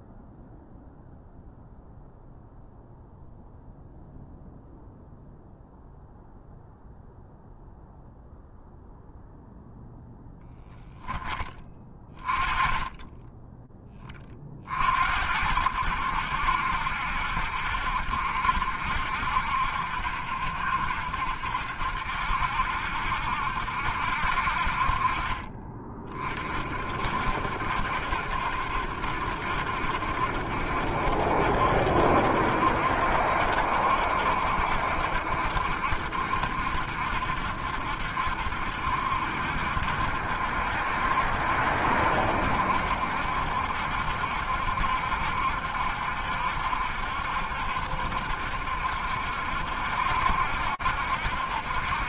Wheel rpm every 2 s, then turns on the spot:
0, 0, 0, 0, 0, 10, 20, 30, 80, 70, 70, 70, 60, 40, 70, 70, 70, 70, 70, 70, 70, 70, 70, 70, 70, 70.
none